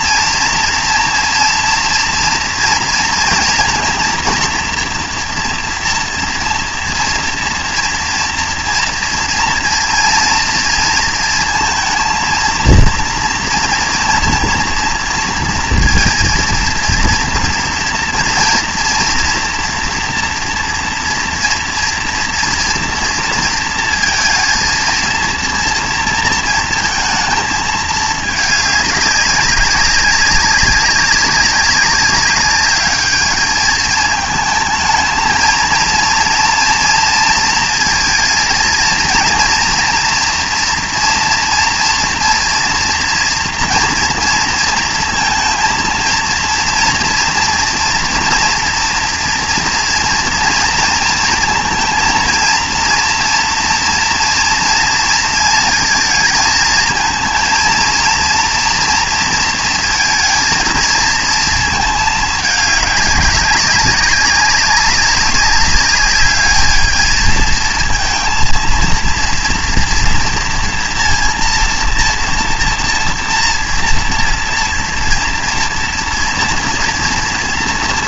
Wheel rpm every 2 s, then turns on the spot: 230, 230, 230, 230, 230, 230, 230, 230, 230, 230, 240, 240, 230, 230, 210, 190, 200, 220, 230, 230, 230, 230, 230, 230, 230, 230, 230, 240, 230, 230, 220, 210, 200, 210, 230, 230, 230, 230, 230.
none